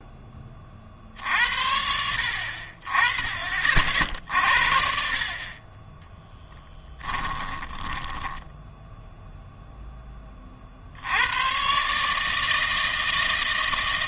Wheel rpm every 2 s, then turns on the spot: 40, 50, 60, 10, 10, 60, 160.
6-10